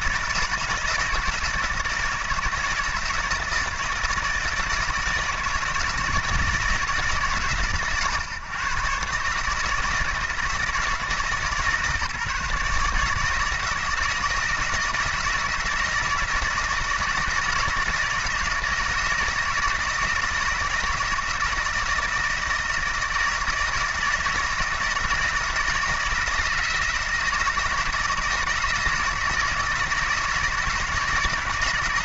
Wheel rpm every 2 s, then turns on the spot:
160, 160, 160, 150, 130, 160, 150, 160, 160, 160, 160, 160, 160, 160, 170, 170.
none